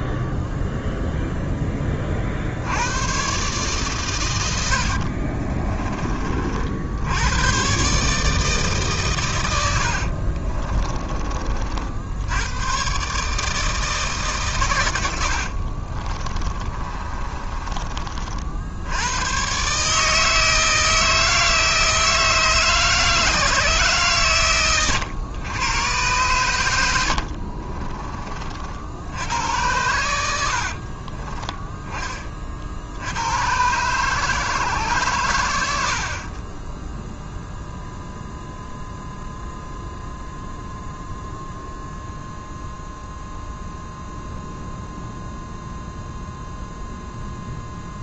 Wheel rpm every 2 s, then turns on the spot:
0, 100, 70, 70, 140, 20, 130, 110, 30, 90, 160, 150, 110, 80, 70, 50, 70, 140, 10, 0, 0, 0, 0, 0.
4-6 16-18 30-32